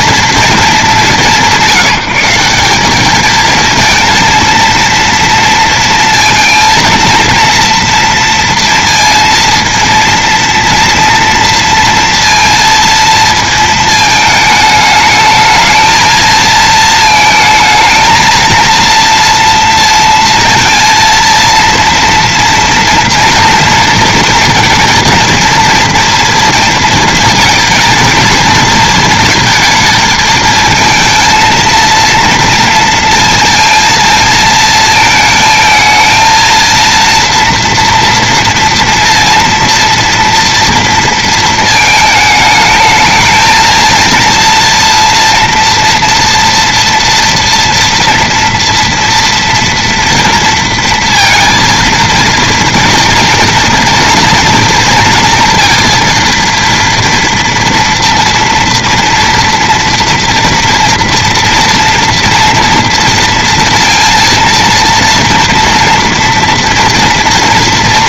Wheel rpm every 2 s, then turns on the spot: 200, 190, 230, 230, 230, 230, 230, 210, 220, 230, 230, 230, 230, 230, 230, 220, 230, 220, 230, 230, 230, 220, 230, 230, 230, 230, 230, 230, 230, 230, 230, 230, 230, 230.
none